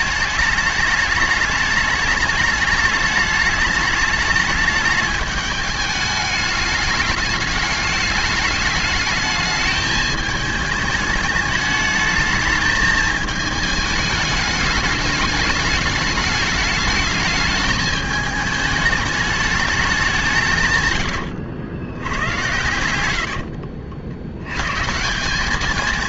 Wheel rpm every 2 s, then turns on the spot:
210, 210, 210, 210, 210, 210, 220, 210, 220, 210, 110, 100, 160.
none